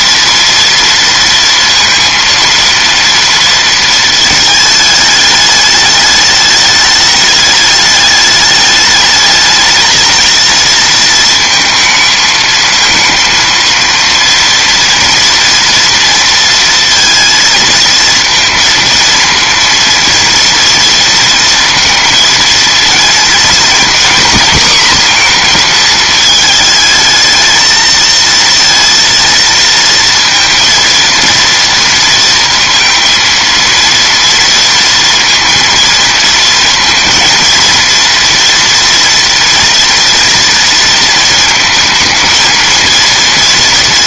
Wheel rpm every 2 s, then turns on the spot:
230, 230, 220, 210, 210, 230, 230, 230, 230, 230, 230, 230, 250, 220, 230, 230, 230, 230, 230, 230, 230, 220.
none